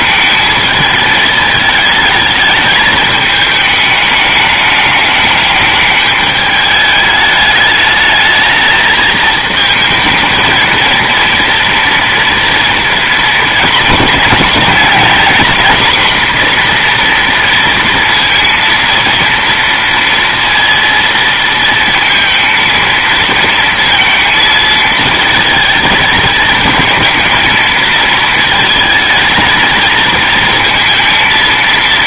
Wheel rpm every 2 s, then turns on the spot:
220, 220, 210, 210, 220, 230, 230, 220, 240, 230, 230, 220, 220, 220, 220, 230.
none